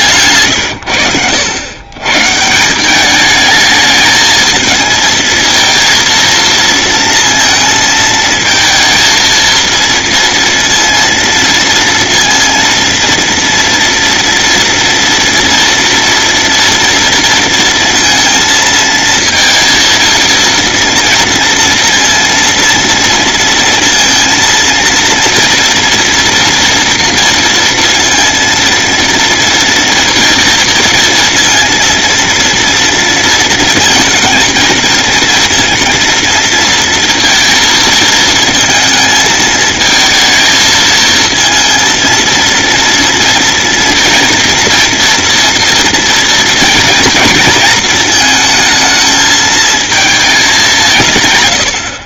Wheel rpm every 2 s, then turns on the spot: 90, 190, 230, 230, 230, 230, 230, 230, 230, 230, 230, 230, 230, 240, 230, 230, 230, 230, 230, 220, 230, 230, 240, 230, 220, 190.
none